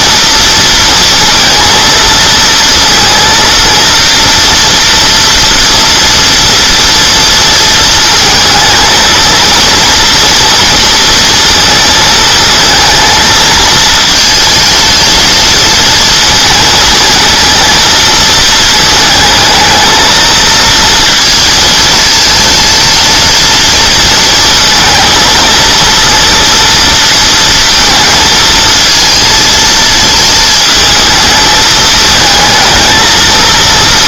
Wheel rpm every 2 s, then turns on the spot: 230, 230, 230, 230, 230, 230, 230, 220, 230, 220, 230, 230, 230, 230, 220, 220, 220.
none